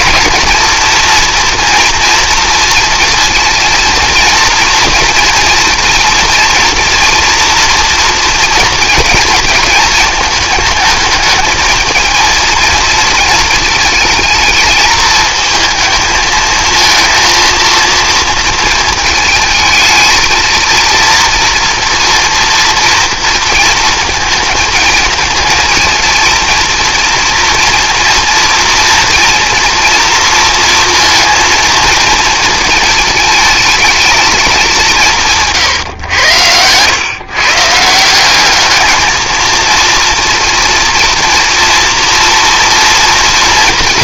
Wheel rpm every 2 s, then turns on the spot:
230, 230, 230, 240, 230, 220, 230, 220, 220, 230, 230, 230, 220, 230, 230, 230, 220, 210, 100, 210, 230, 240.
none